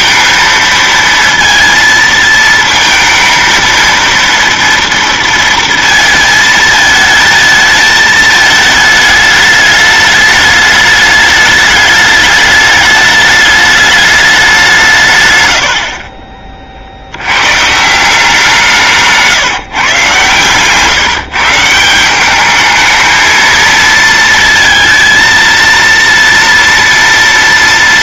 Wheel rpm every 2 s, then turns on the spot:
230, 230, 230, 220, 220, 210, 210, 170, 60, 160, 140, 220, 230, 230.
none